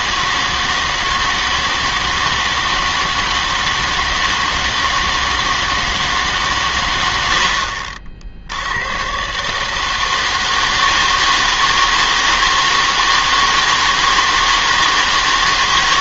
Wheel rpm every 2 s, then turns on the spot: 160, 160, 160, 120, 90, 160, 160, 160.
none